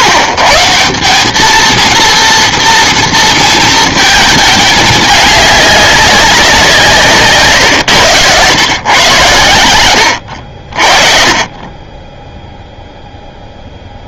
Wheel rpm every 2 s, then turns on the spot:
130, 230, 210, 190, 110, 60, 0.
none